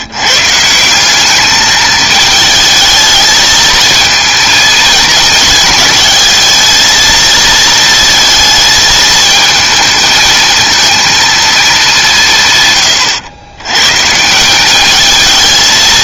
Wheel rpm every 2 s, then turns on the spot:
180, 220, 220, 220, 220, 230, 120, 200.
none